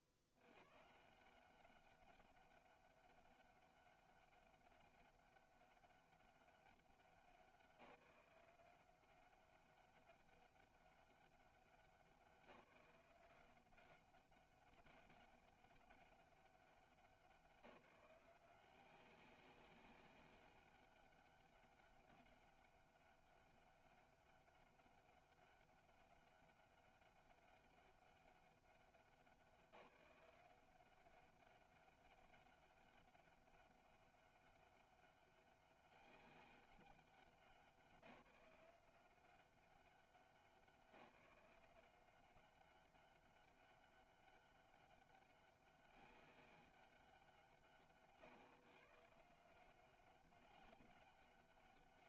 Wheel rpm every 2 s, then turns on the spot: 70, 200, 200, 190, 180, 200, 180, 190, 200, 180, 200, 200, 200, 200, 190, 190, 200, 200, 200, 180, 190, 190, 200, 200, 150, 200.
none